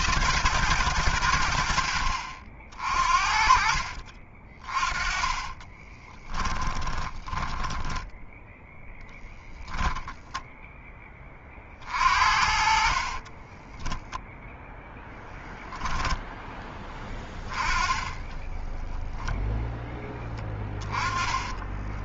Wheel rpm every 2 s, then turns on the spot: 90, 40, 30, 10, 10, 20, 40, 10, 10, 0, 20.
4-10 12-14 20-22